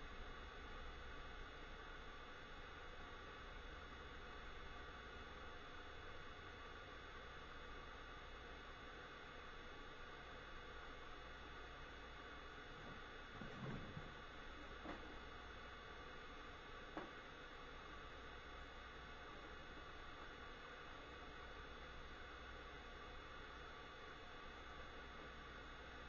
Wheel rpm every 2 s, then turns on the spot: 0, 0, 0, 0, 0, 0, 0, 0, 0, 0, 0, 0, 0.
none